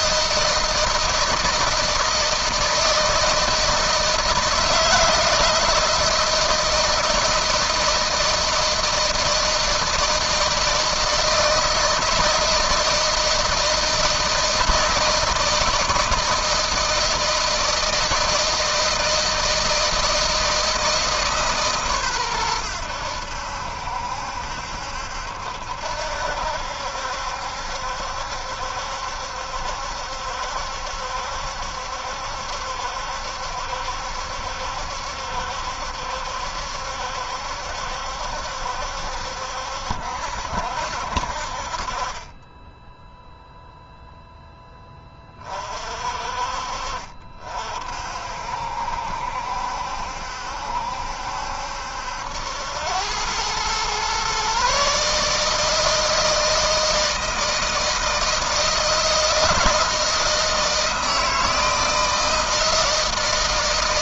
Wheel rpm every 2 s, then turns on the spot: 160, 160, 160, 160, 160, 160, 160, 160, 160, 160, 160, 90, 70, 70, 70, 70, 70, 70, 70, 70, 60, 10, 20, 50, 60, 70, 100, 150, 160, 160, 160, 160.
none